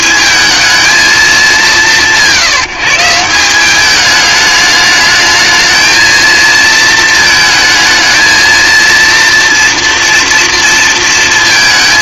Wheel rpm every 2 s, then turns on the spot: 220, 170, 210, 230, 230, 230.
none